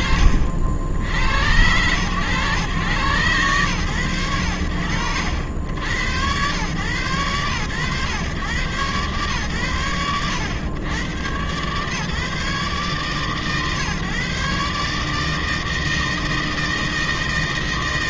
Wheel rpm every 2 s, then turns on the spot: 60, 110, 70, 110, 110, 110, 140, 150, 160.
none